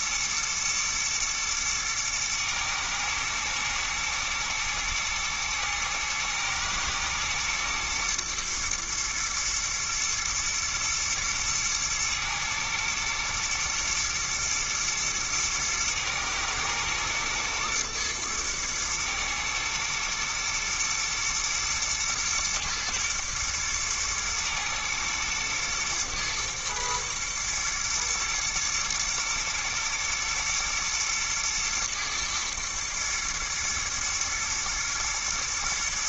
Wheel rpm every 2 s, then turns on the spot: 120, 110, 110, 110, 110, 120, 110, 120, 110, 110, 120, 110, 110, 110, 120, 120, 120, 110.
none